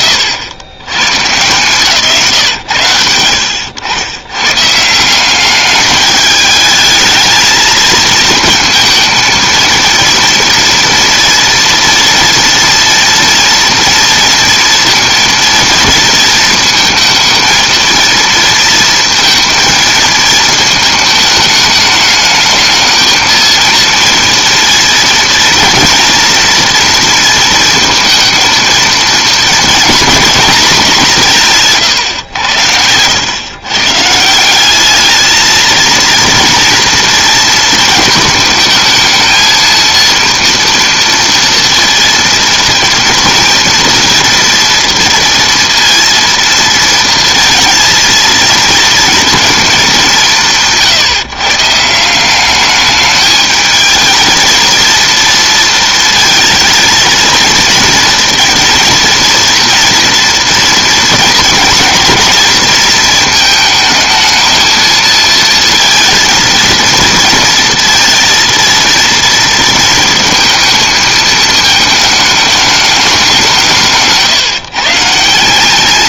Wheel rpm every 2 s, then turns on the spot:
70, 80, 180, 210, 220, 230, 230, 230, 220, 230, 220, 220, 230, 230, 230, 200, 90, 210, 230, 220, 230, 230, 230, 230, 230, 140, 210, 230, 230, 230, 220, 220, 220, 230, 230, 220, 200, 140.
none